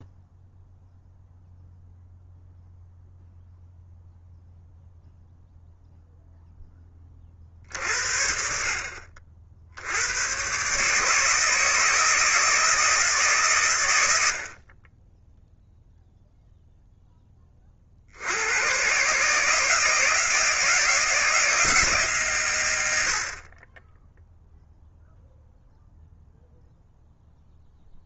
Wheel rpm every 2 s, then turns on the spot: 0, 0, 0, 10, 60, 150, 160, 30, 10, 130, 160, 80, 0, 0.
none